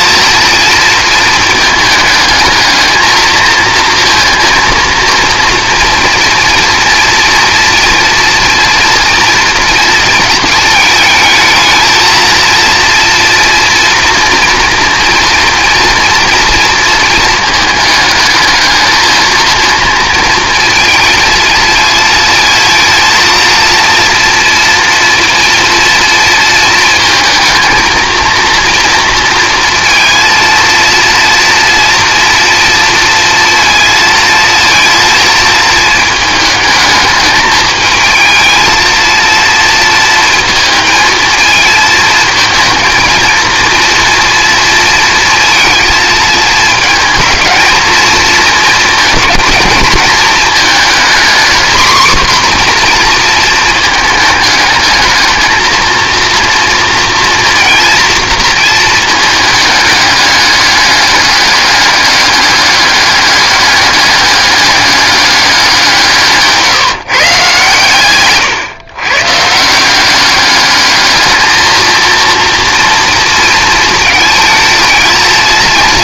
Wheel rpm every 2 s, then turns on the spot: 230, 220, 230, 230, 230, 220, 230, 230, 230, 220, 230, 230, 230, 230, 230, 230, 230, 230, 220, 230, 230, 230, 230, 220, 230, 230, 250, 220, 230, 220, 200, 200, 200, 160, 120, 210, 230, 220.
none